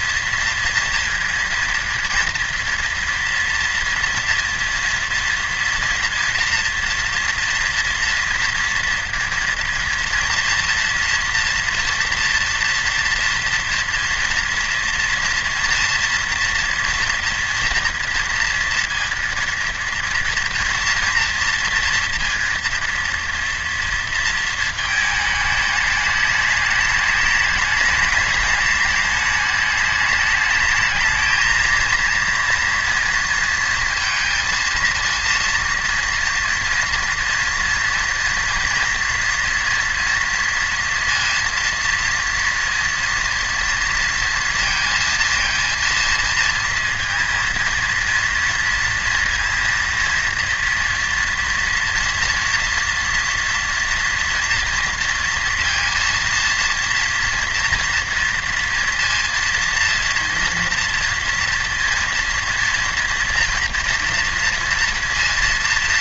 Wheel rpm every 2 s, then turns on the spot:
230, 240, 240, 230, 230, 230, 230, 230, 230, 230, 240, 230, 220, 210, 210, 220, 230, 230, 230, 240, 230, 230, 230, 230, 230, 230, 230, 230, 230, 230, 230, 230, 230.
none